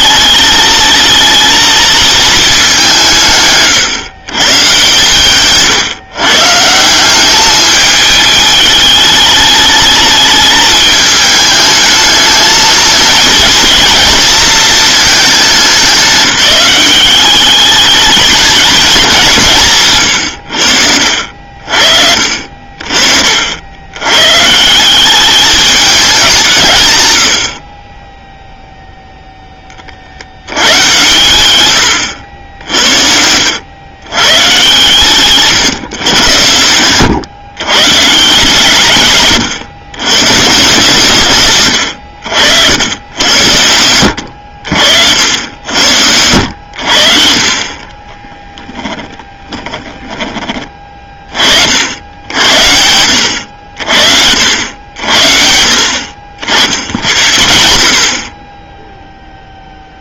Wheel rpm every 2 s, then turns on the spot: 220, 190, 140, 160, 210, 210, 220, 220, 190, 220, 80, 50, 170, 140, 0, 110, 70, 130, 110, 140, 150, 90, 80, 80, 20, 30, 70, 70, 60, 10.
32-34 48-50